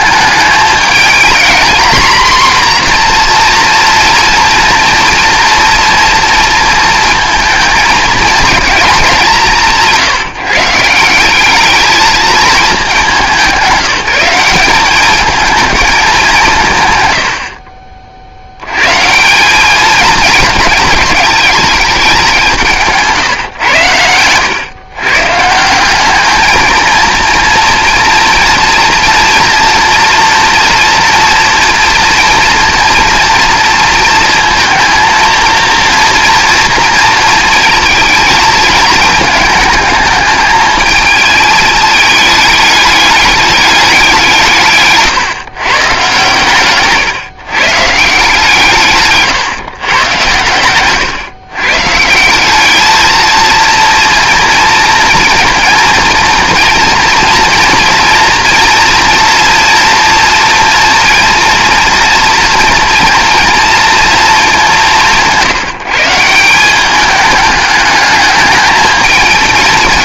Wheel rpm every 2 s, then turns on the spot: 210, 240, 230, 230, 220, 160, 210, 190, 140, 110, 210, 160, 120, 220, 230, 240, 230, 220, 230, 220, 220, 210, 150, 130, 160, 120, 210, 230, 230, 230, 230, 230, 200, 190, 220.
50-52